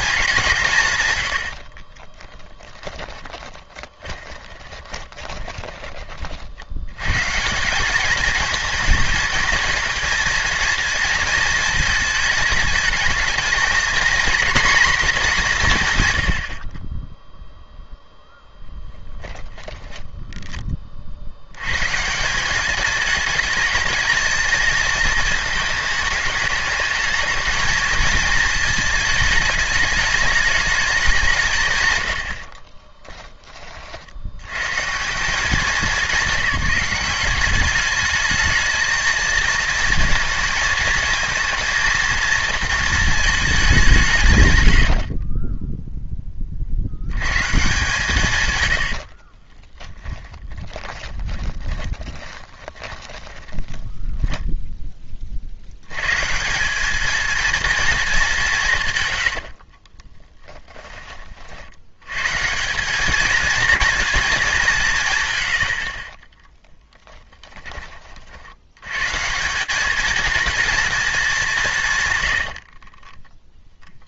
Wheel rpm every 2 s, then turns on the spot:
130, 20, 20, 70, 220, 230, 220, 230, 30, 0, 30, 200, 230, 210, 220, 210, 30, 140, 190, 220, 230, 230, 100, 90, 90, 20, 20, 10, 200, 140, 20, 180, 190, 20, 120, 220, 40.
2-6 32-34 44-46 48-54 66-68 72-74